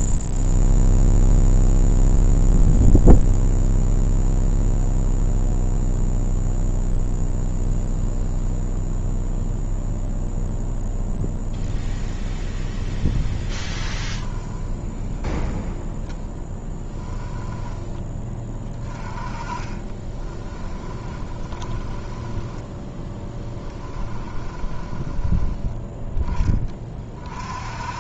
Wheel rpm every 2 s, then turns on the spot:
0, 0, 0, 0, 0, 0, 0, 10, 10, 20, 20, 10, 20, 30.
16-18 20-26